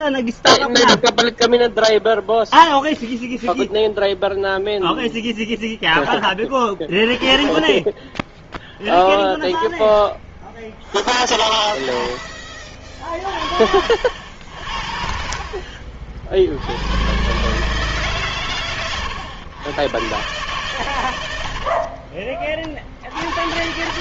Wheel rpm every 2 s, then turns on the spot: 0, 0, 0, 20, 10, 10, 50, 60, 110, 120, 100, 60.
10-12 20-22